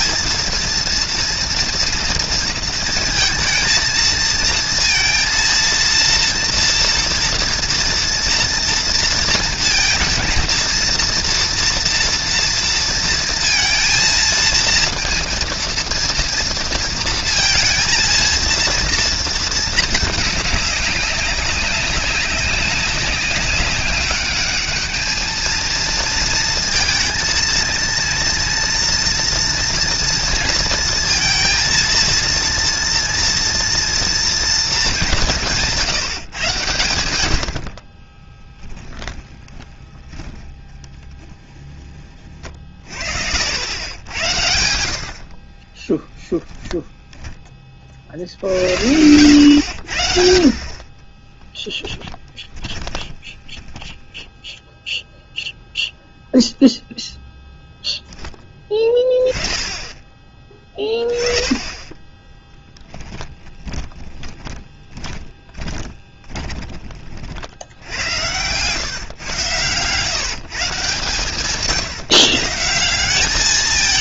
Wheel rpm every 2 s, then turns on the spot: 230, 230, 230, 230, 230, 230, 230, 230, 230, 230, 200, 200, 210, 230, 230, 230, 230, 210, 100, 20, 20, 40, 80, 10, 80, 30, 10, 0, 0, 10, 10, 10, 20, 40, 120, 140, 160.
38-44 46-48 50-54 62-66